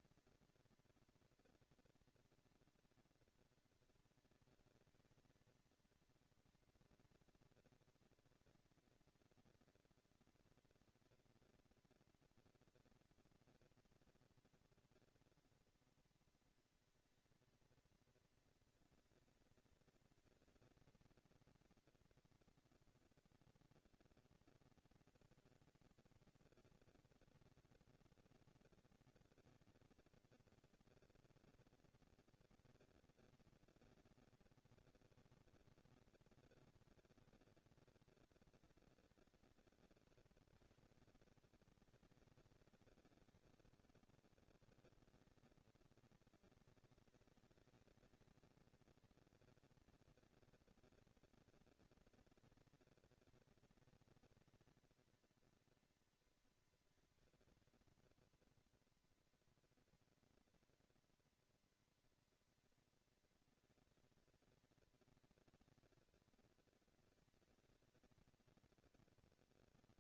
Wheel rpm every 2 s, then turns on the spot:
230, 230, 230, 230, 230, 230, 230, 230, 230, 230, 230, 230, 230, 230, 230, 230, 220, 230, 230, 190, 190, 210, 220, 230, 230, 230, 230, 230, 230, 240, 230, 230, 230, 230, 230.
none